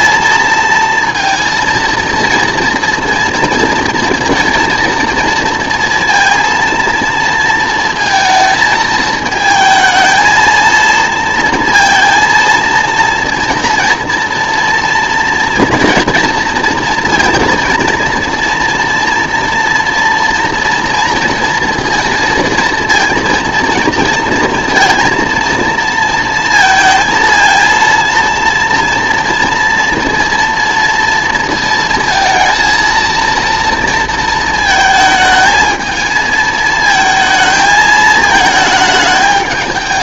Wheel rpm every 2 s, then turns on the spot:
230, 230, 230, 230, 220, 220, 230, 230, 230, 230, 230, 230, 230, 230, 230, 230, 230, 230, 220, 220.
none